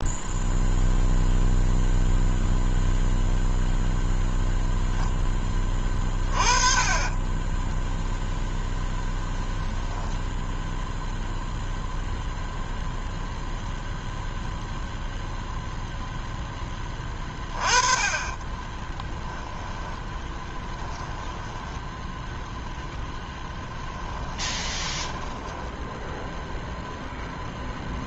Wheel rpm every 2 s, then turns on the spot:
0, 0, 0, 30, 0, 0, 0, 0, 20, 10, 10, 20, 20, 0.
18-26